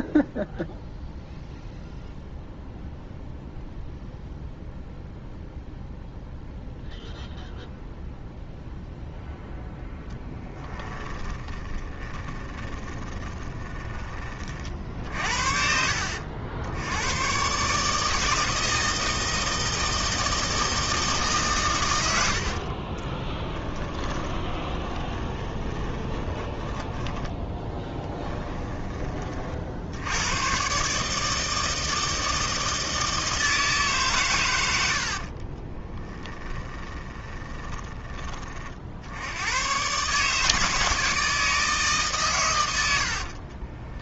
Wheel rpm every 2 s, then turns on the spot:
0, 0, 0, 0, 0, 10, 20, 50, 90, 160, 160, 30, 20, 10, 20, 140, 160, 80, 20, 60, 160, 80.
10-14 22-28 34-38 42-44